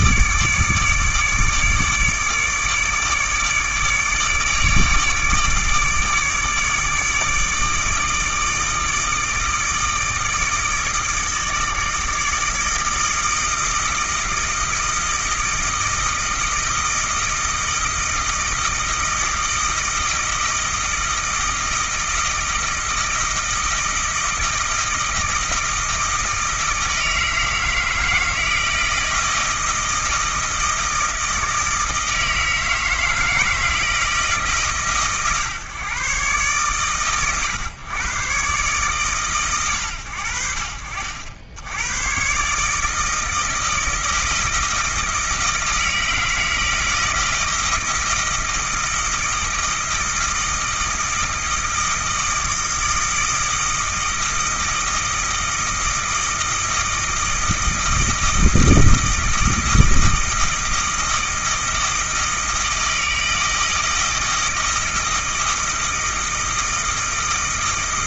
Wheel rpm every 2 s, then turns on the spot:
150, 150, 150, 150, 160, 160, 160, 160, 160, 160, 160, 160, 160, 160, 160, 160, 160, 150, 120, 130, 70, 140, 160, 160, 160, 160, 160, 160, 160, 160, 160, 160, 160, 160.
none